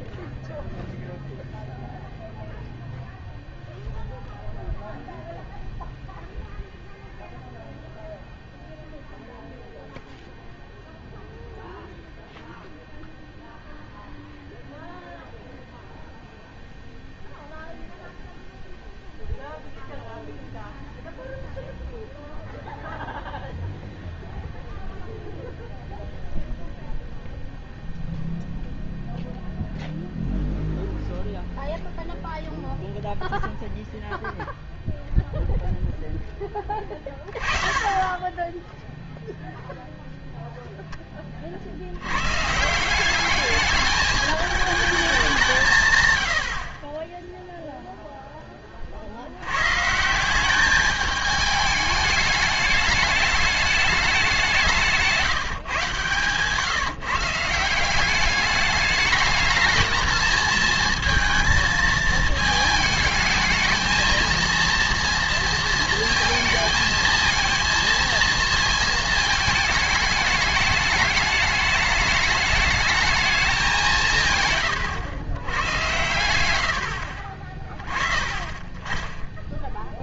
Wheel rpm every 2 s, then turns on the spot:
0, 0, 0, 0, 0, 0, 0, 0, 0, 0, 0, 0, 0, 0, 0, 0, 0, 0, 10, 10, 0, 150, 220, 60, 20, 200, 210, 190, 140, 200, 230, 220, 230, 220, 230, 210, 210, 130, 90, 20.
none